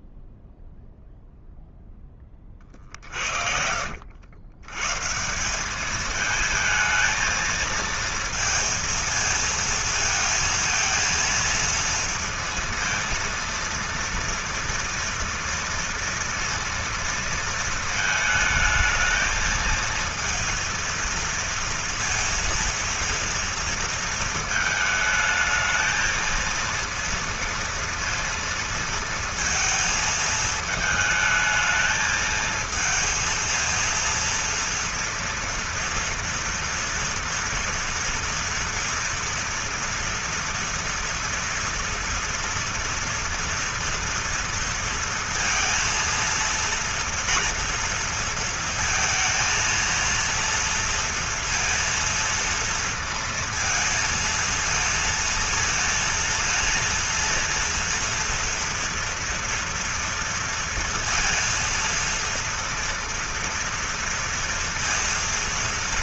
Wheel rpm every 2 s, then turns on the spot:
0, 50, 140, 220, 230, 230, 230, 230, 230, 220, 230, 230, 220, 230, 230, 220, 230, 230, 230, 230, 230, 230, 230, 230, 230, 230, 230, 230, 230, 230, 230, 230, 230.
2-4